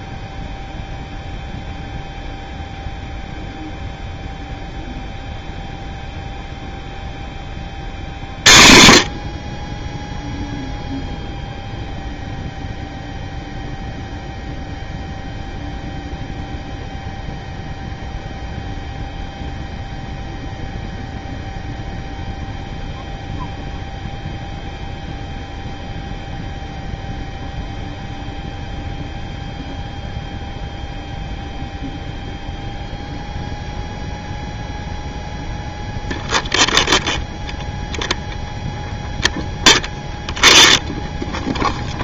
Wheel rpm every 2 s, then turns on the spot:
0, 0, 0, 0, 50, 0, 0, 0, 0, 0, 0, 0, 0, 0, 0, 0, 0, 0, 0, 0, 0.
none